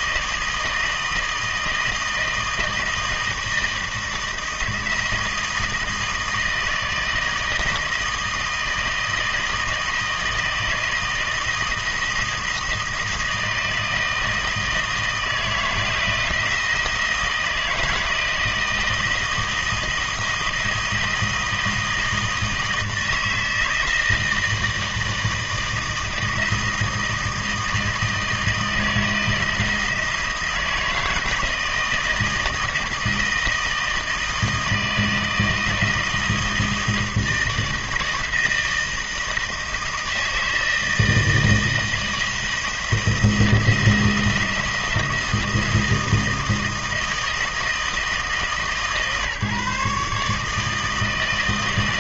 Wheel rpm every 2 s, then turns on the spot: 160, 160, 160, 160, 160, 160, 160, 160, 160, 170, 160, 160, 160, 160, 160, 160, 160, 160, 170, 160, 160, 160, 170, 160, 150, 160.
none